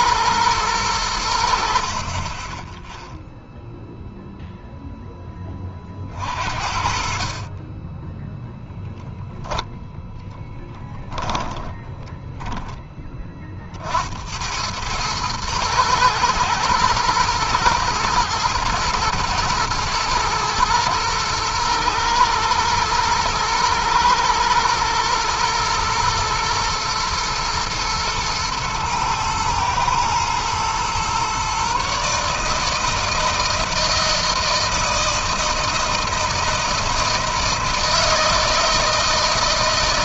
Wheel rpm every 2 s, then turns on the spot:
100, 0, 0, 40, 0, 10, 10, 100, 110, 120, 110, 110, 120, 120, 120, 120, 160, 160, 160, 160.
none